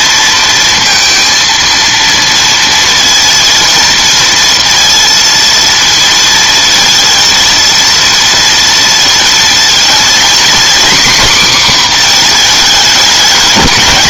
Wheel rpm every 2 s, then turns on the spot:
230, 230, 230, 230, 230, 260, 220.
none